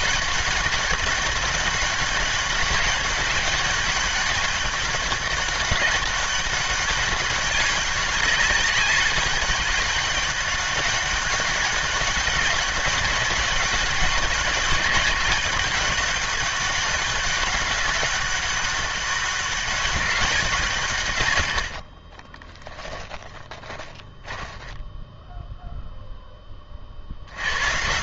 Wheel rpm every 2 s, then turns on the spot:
200, 200, 200, 190, 200, 200, 200, 190, 200, 200, 180, 20, 10, 30.
22-26